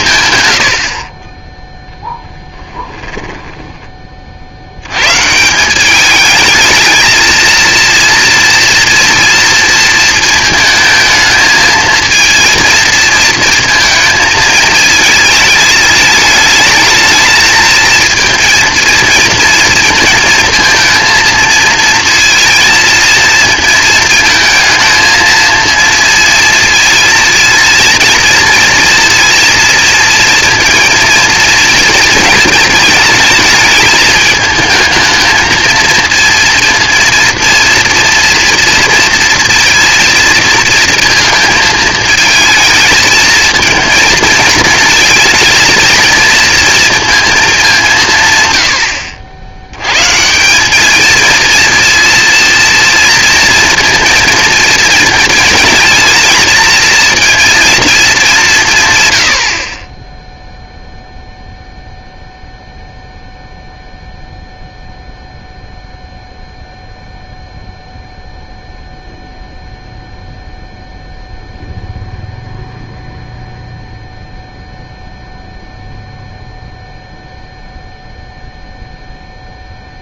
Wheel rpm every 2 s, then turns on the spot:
100, 10, 80, 220, 230, 220, 230, 220, 220, 230, 230, 230, 220, 230, 230, 230, 230, 220, 230, 230, 230, 220, 220, 230, 110, 190, 230, 220, 220, 160, 0, 0, 0, 0, 0, 0, 0, 0, 0, 0.
0-4